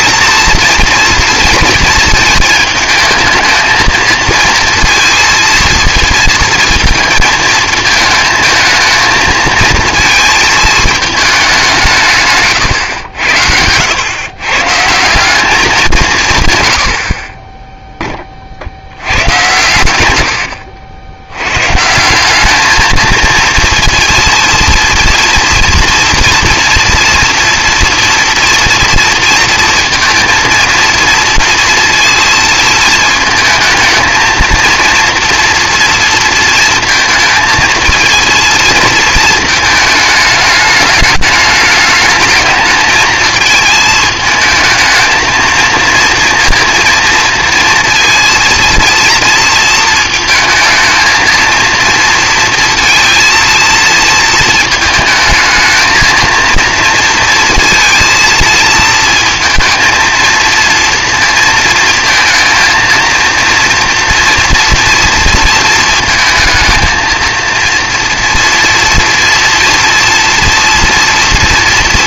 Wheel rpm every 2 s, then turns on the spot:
230, 220, 230, 230, 220, 220, 110, 140, 100, 80, 70, 220, 240, 230, 240, 230, 230, 230, 230, 230, 210, 220, 220, 230, 230, 220, 230, 220, 230, 220, 230, 230, 230, 220, 230, 230.
none